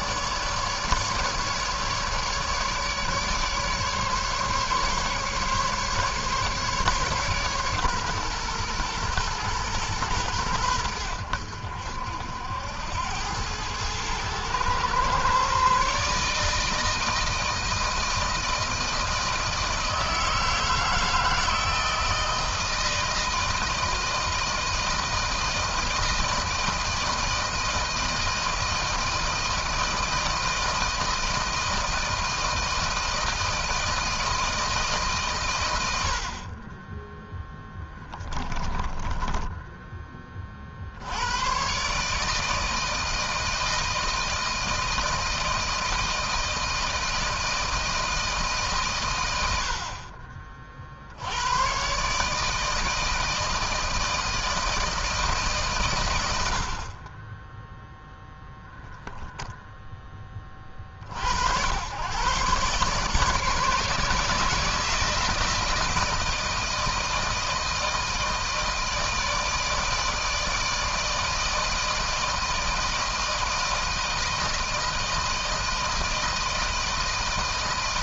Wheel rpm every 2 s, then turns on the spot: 150, 150, 140, 140, 120, 100, 80, 120, 160, 160, 160, 160, 160, 160, 160, 160, 160, 160, 20, 20, 50, 160, 160, 160, 150, 50, 160, 160, 60, 10, 40, 140, 160, 160, 160, 160, 160, 160, 160.
38-40